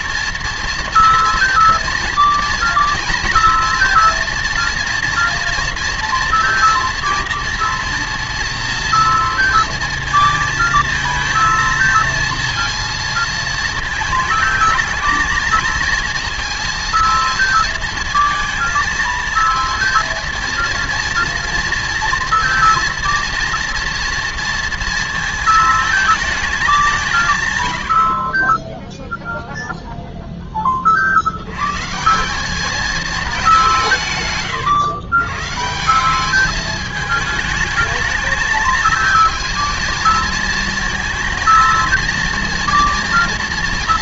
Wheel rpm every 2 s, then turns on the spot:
240, 230, 230, 240, 230, 220, 230, 220, 230, 230, 230, 230, 230, 210, 20, 10, 200, 110, 210, 220, 230, 230.
none